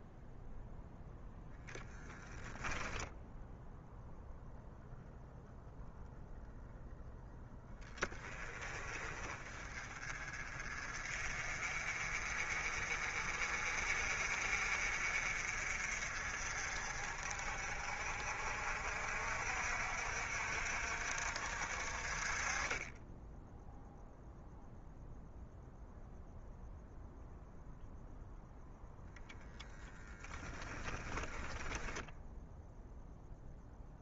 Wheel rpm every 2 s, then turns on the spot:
0, 10, 0, 0, 30, 40, 40, 50, 50, 50, 60, 20, 0, 0, 0, 10, 0.
none